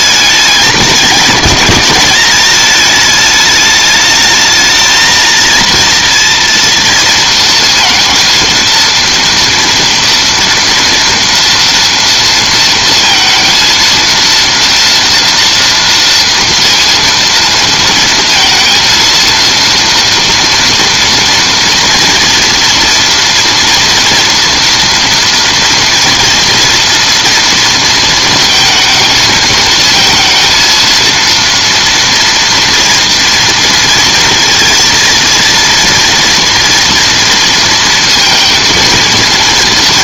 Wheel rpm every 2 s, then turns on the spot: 200, 210, 220, 230, 230, 230, 230, 230, 230, 230, 240, 240, 230, 230, 230, 230, 240, 230, 230, 230.
none